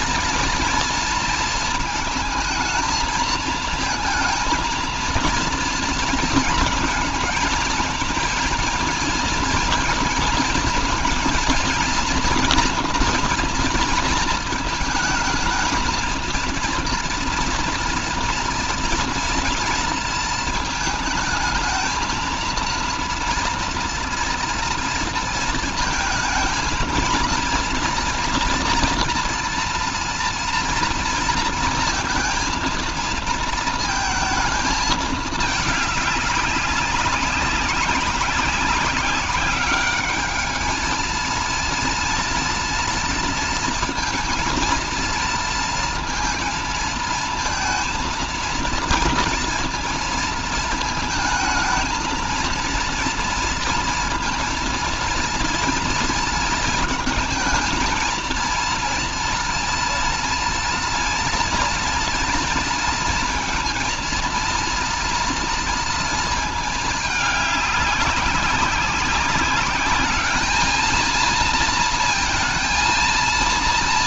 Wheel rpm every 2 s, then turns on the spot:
230, 220, 230, 220, 230, 230, 230, 230, 230, 230, 220, 230, 230, 220, 230, 230, 230, 220, 200, 190, 210, 230, 230, 230, 230, 230, 230, 230, 220, 230, 230, 230, 230, 220, 190, 220, 230.
none